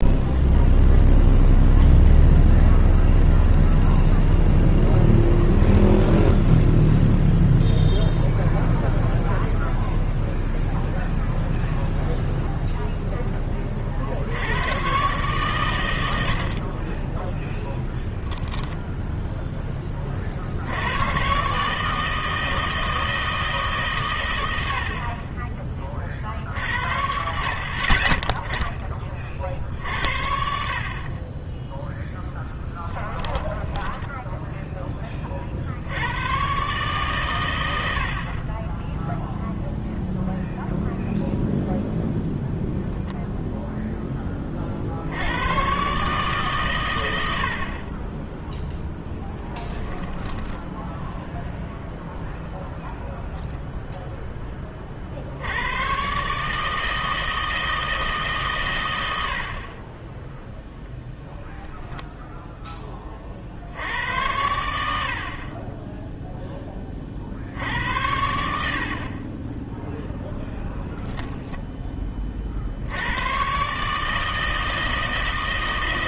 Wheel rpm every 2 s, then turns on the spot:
0, 0, 0, 0, 0, 0, 0, 100, 40, 20, 70, 160, 70, 60, 10, 50, 10, 10, 130, 10, 0, 0, 40, 130, 0, 10, 0, 20, 150, 110, 0, 10, 80, 10, 60, 10, 70, 160.
32-34 50-52